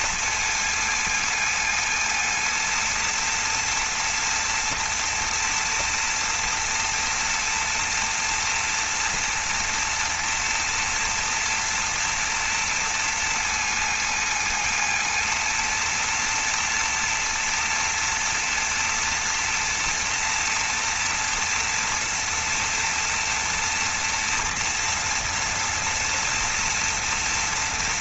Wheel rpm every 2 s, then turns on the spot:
230, 230, 230, 230, 230, 230, 230, 230, 230, 240, 240, 240, 230, 230.
none